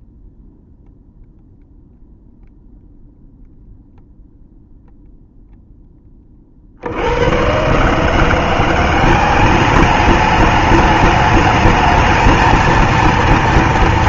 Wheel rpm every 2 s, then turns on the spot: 0, 0, 0, 40, 170, 210, 220.
none